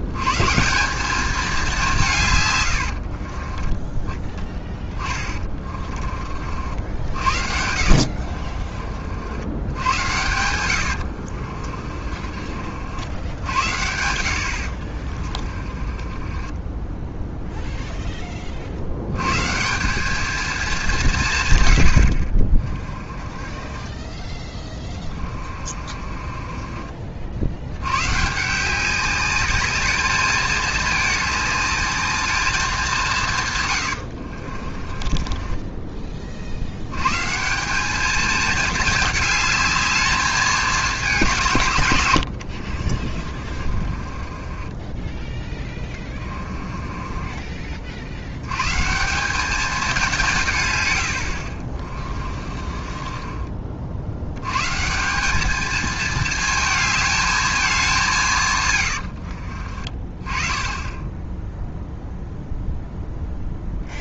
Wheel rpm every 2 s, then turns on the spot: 160, 120, 20, 50, 50, 90, 60, 60, 20, 40, 210, 30, 20, 30, 170, 210, 200, 40, 80, 220, 210, 70, 20, 20, 120, 130, 40, 130, 220, 120, 20, 0.
2-6 8-12 14-18 22-28 34-36 42-48 52-54 58-60